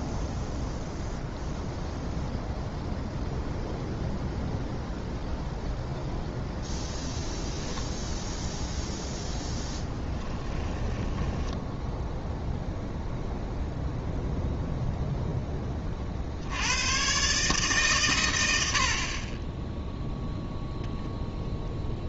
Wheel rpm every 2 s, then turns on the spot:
0, 0, 0, 0, 10, 0, 0, 90, 80, 0, 30.
8-10